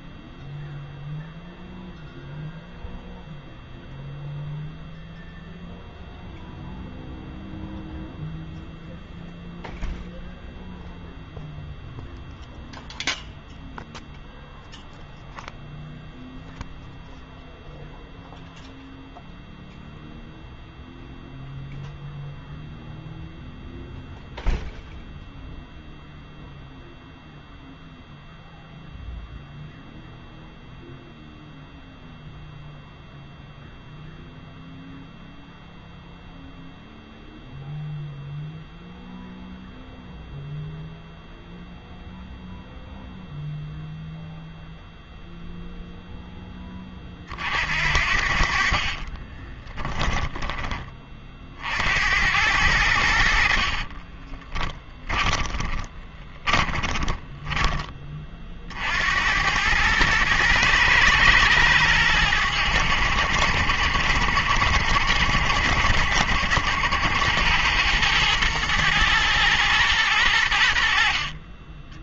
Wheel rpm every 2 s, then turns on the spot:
0, 0, 0, 0, 0, 0, 0, 0, 0, 0, 0, 0, 0, 0, 0, 0, 0, 0, 0, 0, 0, 0, 0, 10, 40, 20, 90, 10, 20, 50, 110, 90, 80, 80, 110, 70.
48-50 54-58